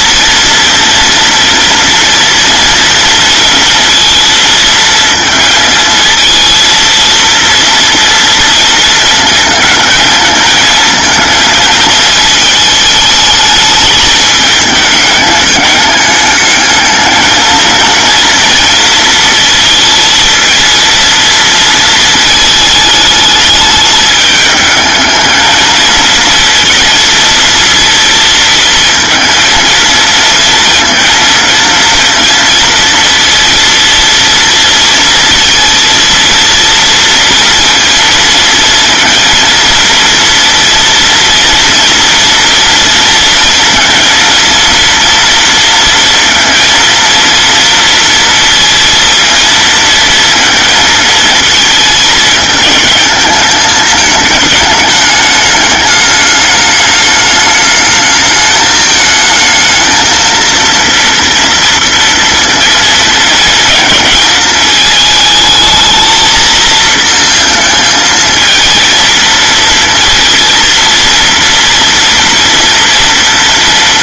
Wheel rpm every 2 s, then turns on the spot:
230, 230, 230, 230, 230, 220, 220, 210, 210, 230, 230, 220, 220, 230, 230, 230, 230, 230, 230, 230, 230, 230, 230, 230, 230, 230, 210, 210, 210, 220, 230, 230, 220, 220, 220, 230, 230.
none